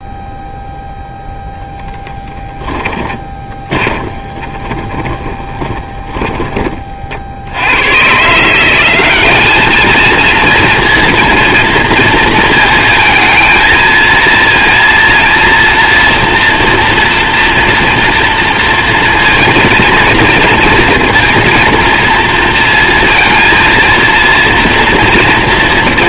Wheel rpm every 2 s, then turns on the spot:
0, 20, 20, 40, 200, 230, 220, 230, 230, 230, 230, 230, 230.
2-6